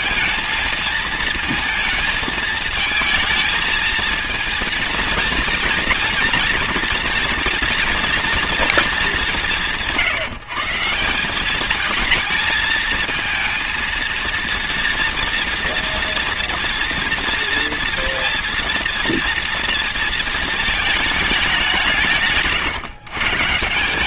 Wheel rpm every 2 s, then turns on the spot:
230, 220, 230, 230, 230, 170, 220, 240, 230, 230, 220, 140.
none